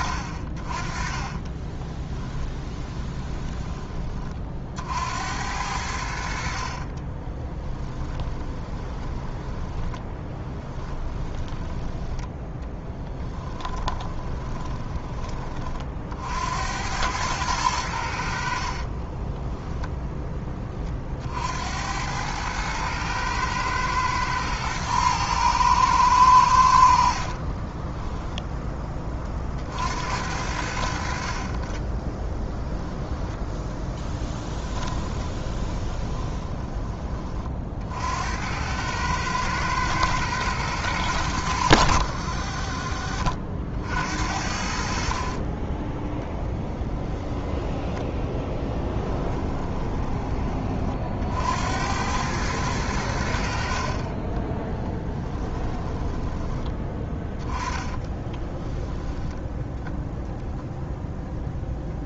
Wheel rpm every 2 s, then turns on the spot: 40, 20, 60, 40, 20, 10, 10, 20, 90, 50, 20, 110, 110, 80, 10, 60, 10, 20, 20, 90, 110, 40, 60, 20, 10, 30, 100, 10, 20, 10, 0.
2-4 6-16 18-20 34-36 46-50 54-56 58-60